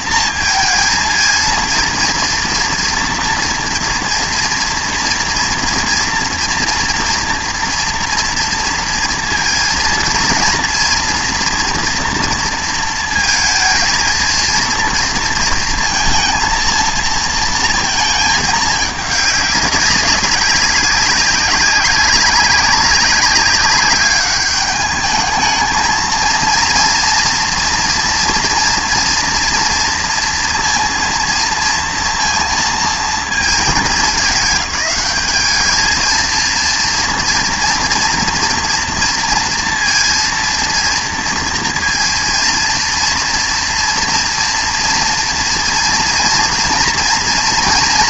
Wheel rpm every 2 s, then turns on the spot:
220, 230, 240, 230, 230, 240, 230, 230, 230, 210, 200, 190, 200, 240, 230, 230, 230, 200, 230, 230, 230, 230, 230, 230.
none